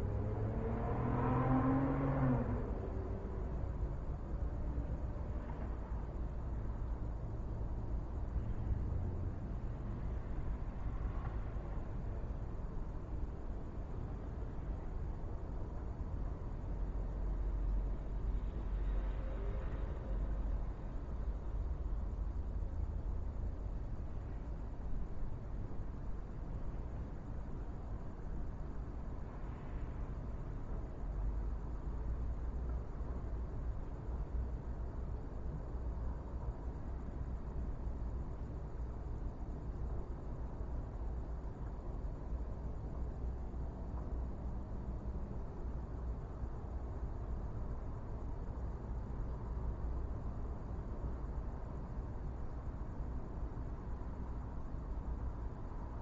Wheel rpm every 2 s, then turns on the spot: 0, 0, 0, 0, 0, 0, 0, 0, 0, 0, 0, 0, 0, 0, 0, 0, 0, 0, 0, 0, 0, 0, 0, 0, 0, 0, 0, 0.
none